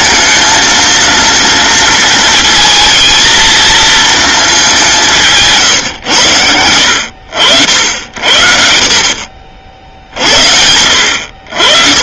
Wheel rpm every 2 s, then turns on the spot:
230, 220, 200, 90, 60, 70.
none